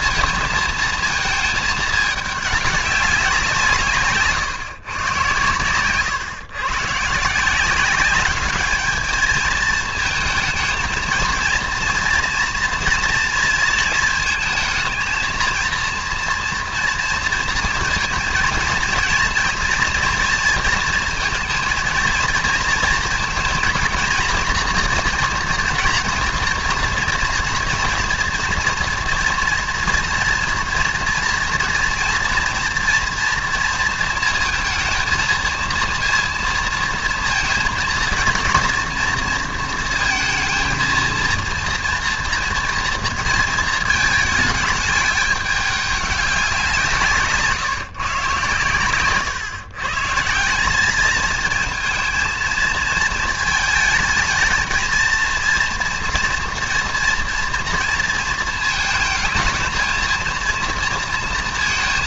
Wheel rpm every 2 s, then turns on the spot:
220, 200, 130, 120, 210, 220, 230, 230, 230, 230, 230, 230, 230, 230, 230, 230, 230, 230, 230, 230, 230, 230, 210, 180, 120, 190, 230, 220, 230, 220, 230.
none